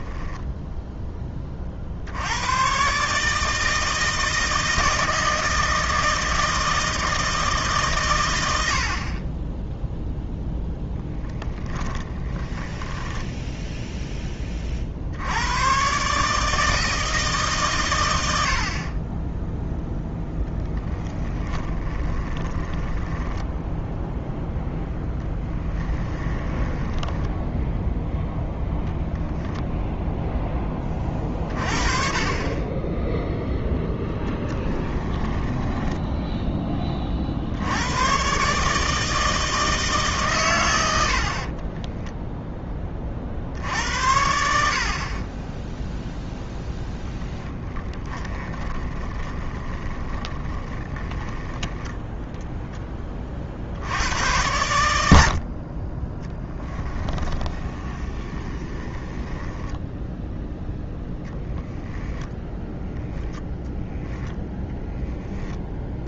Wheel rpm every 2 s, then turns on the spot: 10, 130, 160, 160, 60, 10, 10, 50, 160, 40, 10, 10, 0, 20, 0, 20, 10, 10, 10, 150, 90, 20, 50, 0, 20, 20, 20, 80, 10, 20, 0, 0, 0.
12-14 22-24 26-28 34-36 48-52 56-60